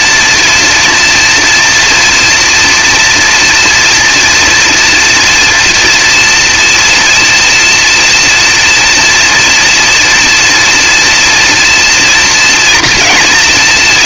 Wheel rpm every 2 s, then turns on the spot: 240, 230, 230, 230, 230, 240, 230.
none